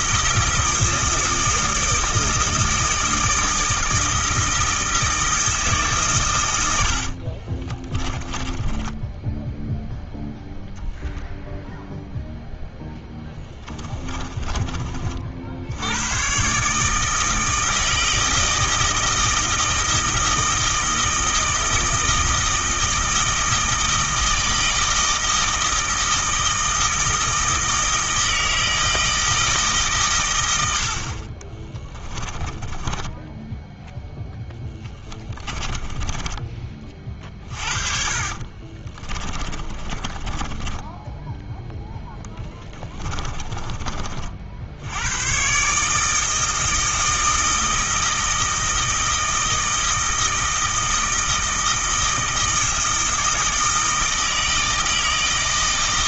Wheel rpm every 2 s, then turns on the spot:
160, 160, 160, 90, 20, 0, 10, 40, 150, 160, 160, 160, 160, 160, 160, 70, 10, 10, 30, 30, 10, 10, 80, 160, 160, 160, 160, 160.
6-10 32-36 38-44